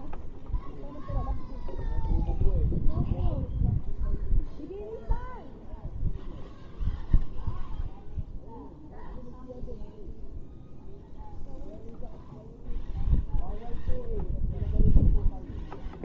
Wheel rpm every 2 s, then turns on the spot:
0, 0, 0, 0, 0, 0, 0, 0.
none